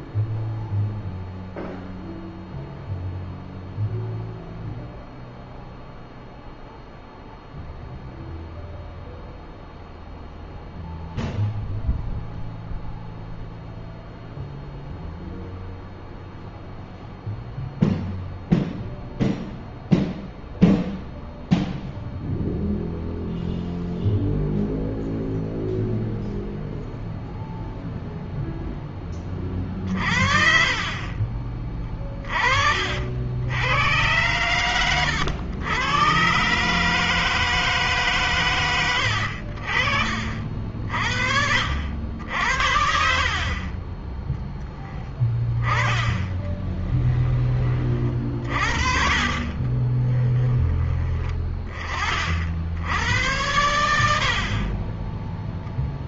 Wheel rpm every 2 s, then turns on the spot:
0, 0, 0, 0, 0, 0, 0, 0, 0, 0, 0, 0, 0, 0, 0, 40, 40, 110, 140, 110, 50, 60, 10, 20, 40, 20, 70, 30.
34-36 38-40 46-50 54-56